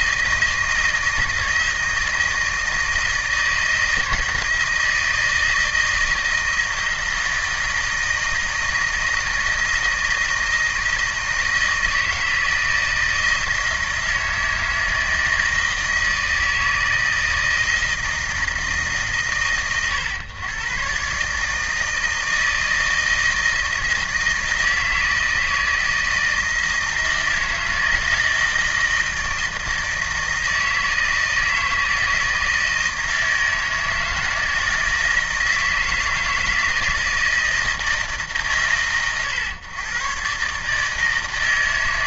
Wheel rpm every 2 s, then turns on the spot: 160, 160, 160, 160, 160, 160, 160, 160, 160, 150, 120, 160, 160, 160, 160, 160, 160, 160, 160, 120, 150.
none